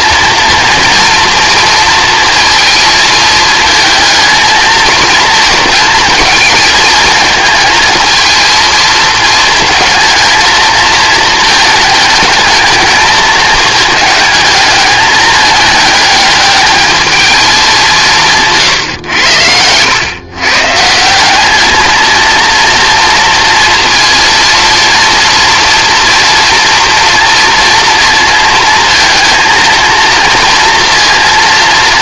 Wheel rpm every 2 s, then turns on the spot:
230, 230, 230, 230, 230, 220, 220, 210, 220, 140, 160, 230, 230, 230, 230, 230.
18-20